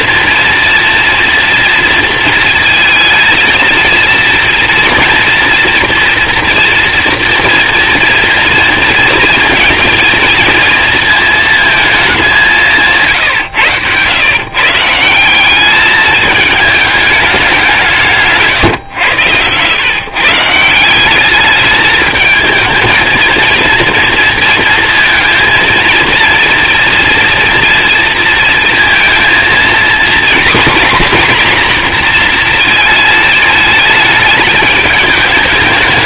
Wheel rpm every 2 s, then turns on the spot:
230, 220, 240, 230, 230, 230, 150, 170, 210, 110, 190, 220, 230, 230, 230, 240, 220, 210.
none